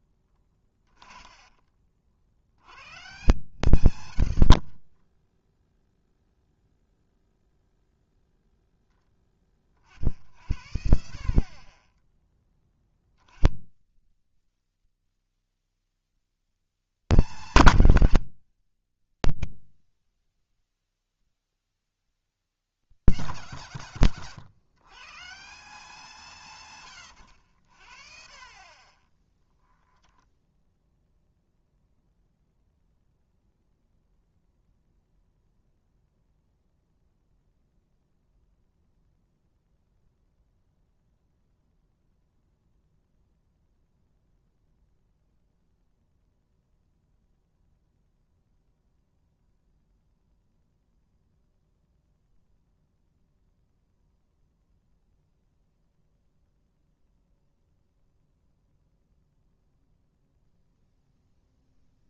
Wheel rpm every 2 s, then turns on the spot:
20, 90, 40, 0, 0, 70, 30, 140, 210, 150, 150, 200, 130, 140, 30, 0, 0, 0, 0, 0, 0, 0, 0, 0, 0, 0, 0, 0, 0, 0, 0.
0-2 14-16 28-30